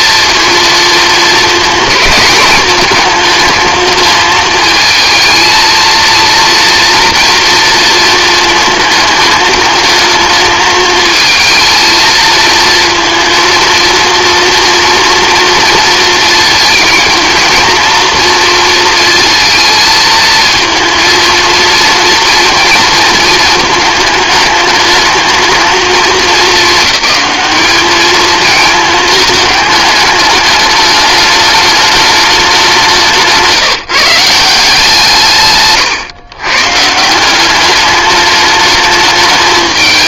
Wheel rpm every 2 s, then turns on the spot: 230, 220, 220, 240, 220, 220, 230, 230, 230, 230, 230, 230, 220, 210, 220, 210, 170, 160, 150, 210.
32-34